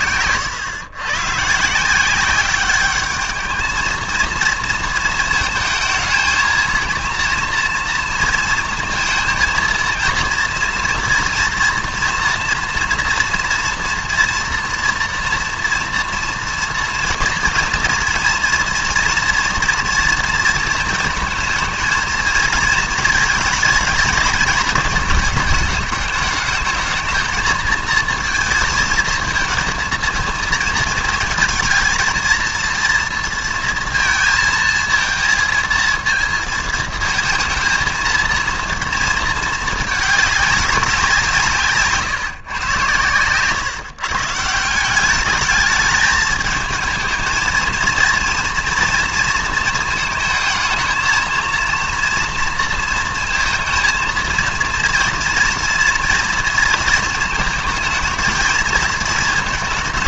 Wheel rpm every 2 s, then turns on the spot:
110, 200, 230, 230, 230, 230, 230, 230, 230, 230, 230, 220, 220, 210, 220, 220, 230, 230, 230, 230, 200, 120, 160, 220, 230, 220, 230, 230, 230, 230.
none